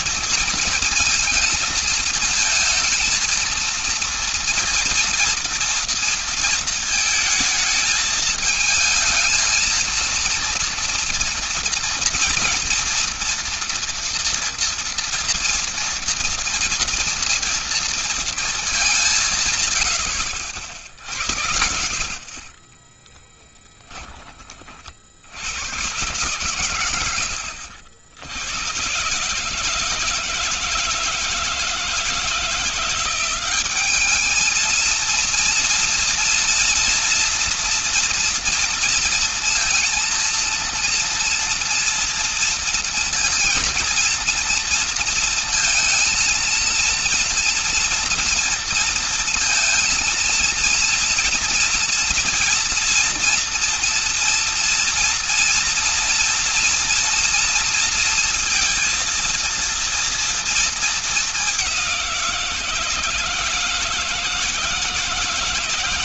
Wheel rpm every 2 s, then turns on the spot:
230, 230, 230, 220, 220, 230, 230, 230, 230, 210, 70, 30, 40, 110, 110, 160, 170, 220, 230, 230, 230, 230, 230, 230, 230, 230, 230, 230, 240, 230, 230, 170, 170.
22-24